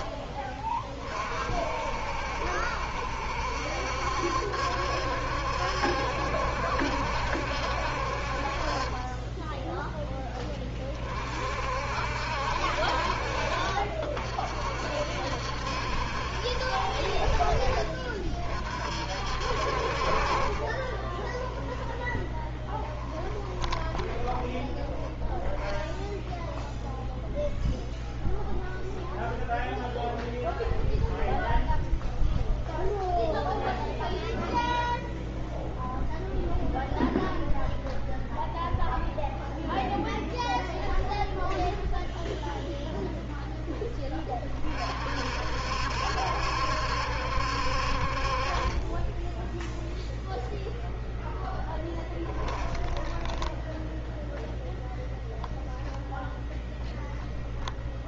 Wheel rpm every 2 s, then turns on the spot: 30, 70, 70, 70, 30, 30, 60, 60, 60, 50, 20, 20, 10, 0, 0, 0, 0, 0, 0, 0, 0, 0, 40, 70, 20, 0, 10, 0, 0.
20-24 52-54